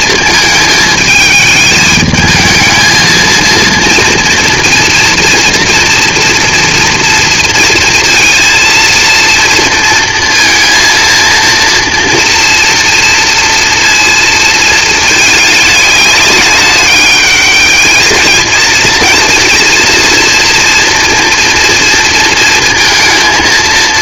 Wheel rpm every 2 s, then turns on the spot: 220, 220, 240, 230, 230, 230, 230, 220, 200, 220, 230, 230.
none